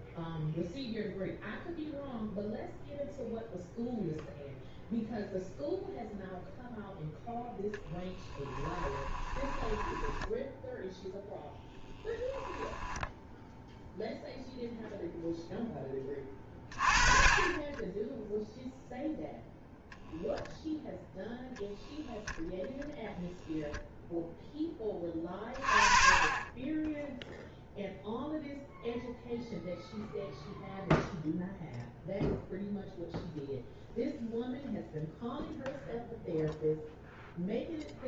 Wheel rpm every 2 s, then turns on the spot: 0, 0, 0, 0, 10, 10, 10, 0, 30, 0, 0, 0, 20, 20, 0, 0, 0, 0, 0.
8-10 12-14